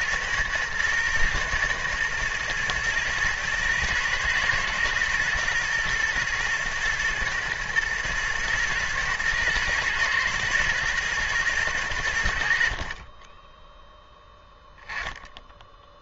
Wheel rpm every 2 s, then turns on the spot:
110, 110, 110, 110, 110, 110, 40, 10.
none